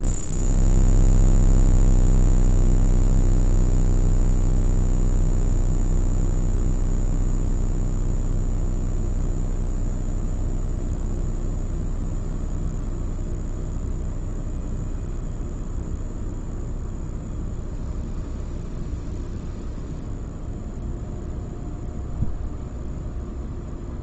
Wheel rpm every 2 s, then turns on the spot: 0, 0, 0, 0, 0, 0, 0, 0, 0, 0, 0, 0.
none